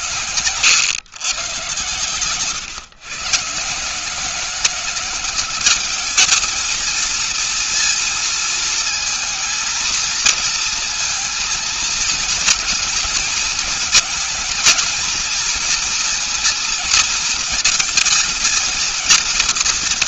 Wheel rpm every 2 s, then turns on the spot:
120, 130, 190, 230, 230, 230, 230, 220, 230, 230.
none